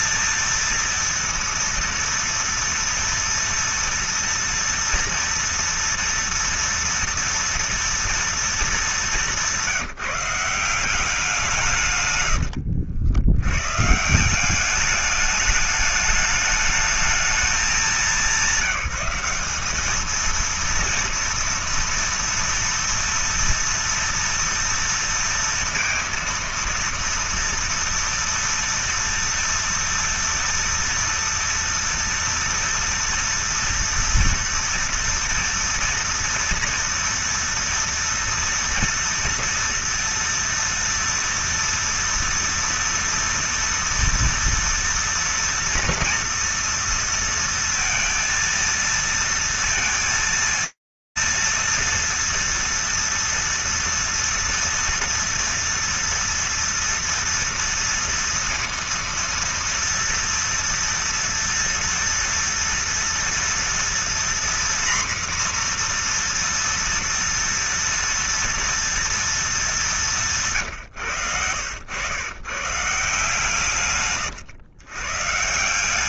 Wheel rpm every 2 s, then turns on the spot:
230, 230, 230, 230, 210, 180, 90, 200, 210, 190, 230, 230, 230, 230, 230, 230, 230, 230, 230, 230, 230, 230, 230, 230, 230, 230, 230, 230, 230, 230, 230, 240, 240, 230, 230, 110, 150, 130.
none